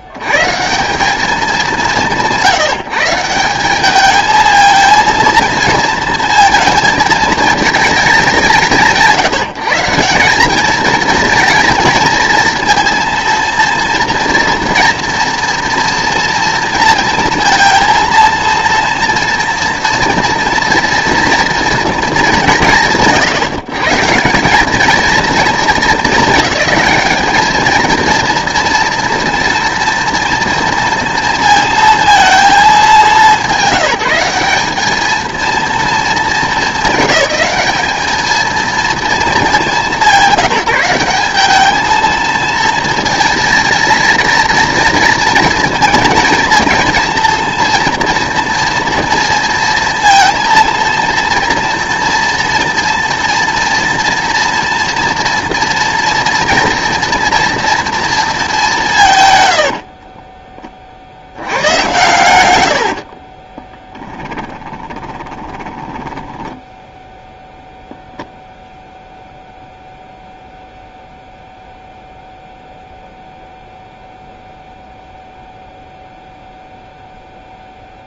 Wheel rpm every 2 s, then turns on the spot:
140, 170, 220, 230, 190, 200, 230, 230, 230, 230, 230, 180, 200, 210, 230, 230, 220, 200, 210, 230, 190, 230, 230, 230, 230, 230, 230, 230, 230, 200, 30, 80, 10, 10, 0, 0, 0, 0, 0.
62-68